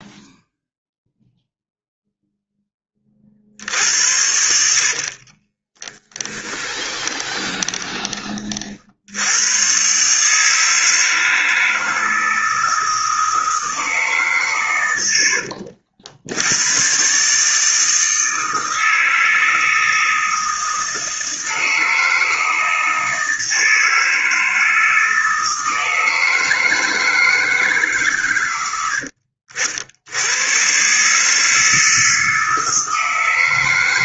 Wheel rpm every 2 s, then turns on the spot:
0, 10, 70, 20, 40, 150, 160, 130, 90, 160, 160, 160, 160, 160, 110, 110, 160.
4-8